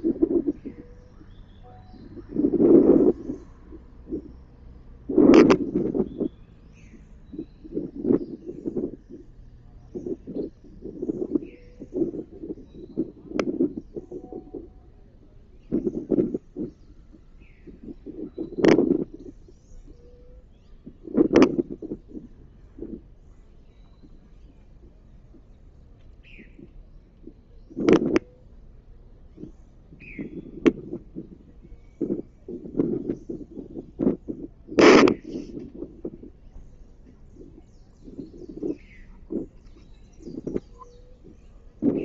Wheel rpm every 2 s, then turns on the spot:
0, 0, 0, 0, 0, 0, 0, 0, 0, 0, 0, 0, 0, 0, 0, 0, 0, 0, 0, 0, 0.
none